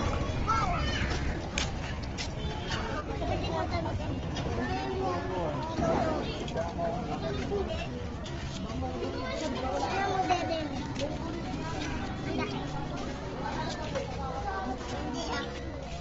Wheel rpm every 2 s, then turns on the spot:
0, 0, 0, 0, 0, 0, 0, 0.
none